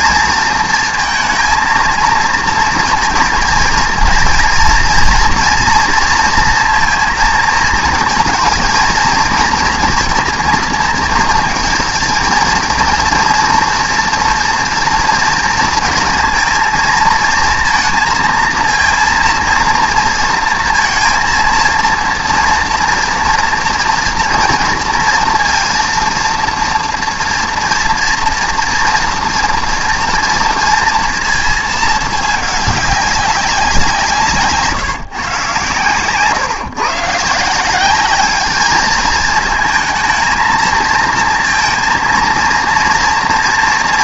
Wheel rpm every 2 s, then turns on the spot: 230, 230, 230, 230, 230, 230, 230, 230, 230, 230, 230, 230, 230, 230, 230, 230, 210, 160, 140, 210, 220, 230.
none